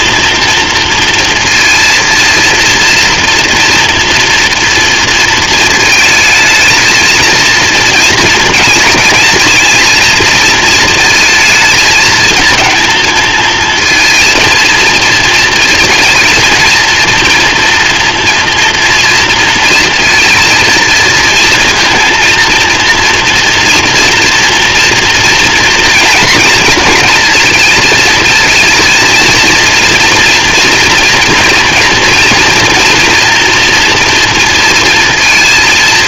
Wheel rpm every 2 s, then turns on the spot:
230, 240, 230, 230, 220, 220, 220, 220, 230, 230, 230, 230, 240, 230, 230, 230, 240, 230.
none